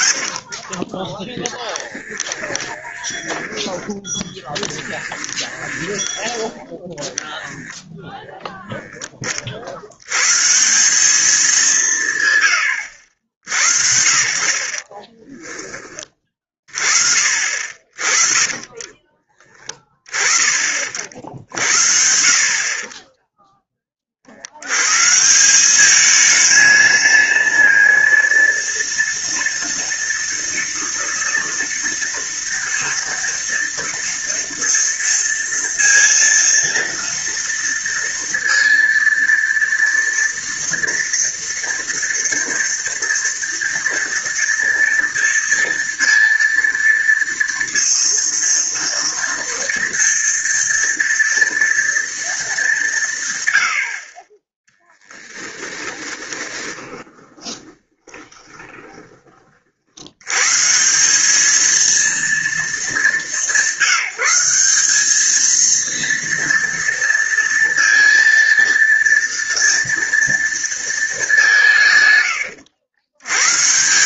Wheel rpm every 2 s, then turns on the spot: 20, 20, 10, 10, 20, 180, 80, 30, 40, 30, 50, 20, 120, 220, 230, 230, 230, 230, 230, 230, 230, 230, 230, 230, 230, 230, 180, 10, 20, 20, 170, 210, 200, 230, 230, 220, 100.
2-6 14-16 18-20 54-60